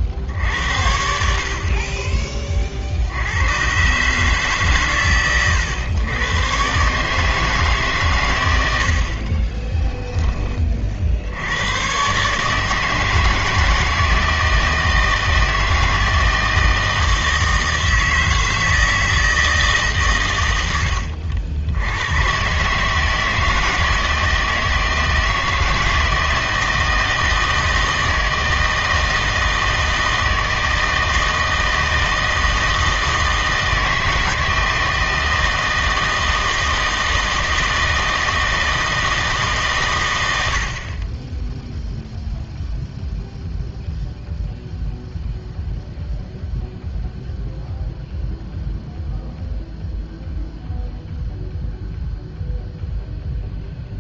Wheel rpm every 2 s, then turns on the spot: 70, 50, 140, 130, 90, 30, 150, 160, 160, 160, 100, 140, 160, 160, 160, 160, 160, 160, 160, 160, 60, 0, 0, 0, 0, 0, 0.
8-10